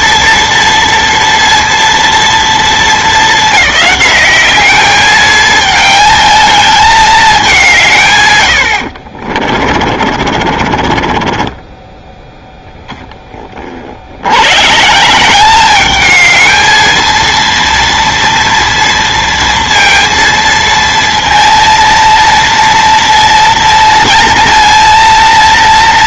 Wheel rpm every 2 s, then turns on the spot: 230, 230, 200, 220, 100, 40, 20, 120, 220, 230, 230, 230, 230.
8-12